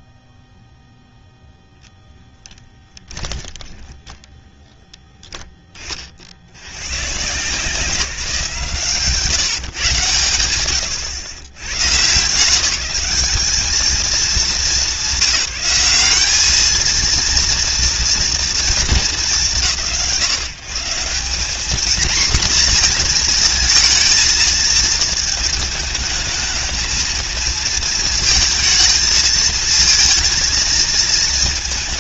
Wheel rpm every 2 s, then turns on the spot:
0, 20, 10, 130, 140, 110, 200, 200, 230, 170, 200, 230, 220, 220, 220, 220.
2-4